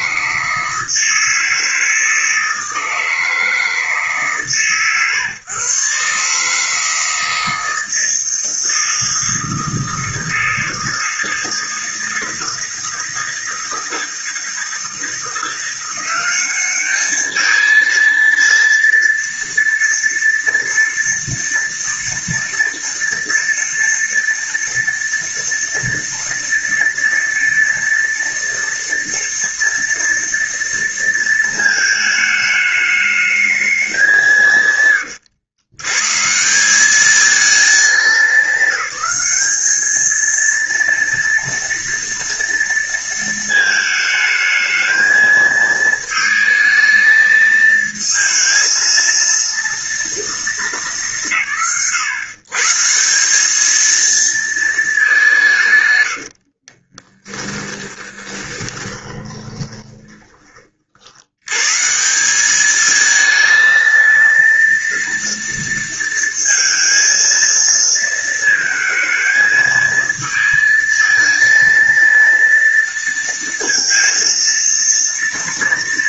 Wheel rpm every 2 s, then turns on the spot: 160, 160, 140, 150, 160, 160, 160, 160, 200, 230, 230, 230, 230, 230, 230, 230, 210, 140, 180, 210, 230, 230, 220, 220, 220, 190, 140, 230, 50, 10, 30, 200, 230, 230, 230, 220, 230, 230.
56-60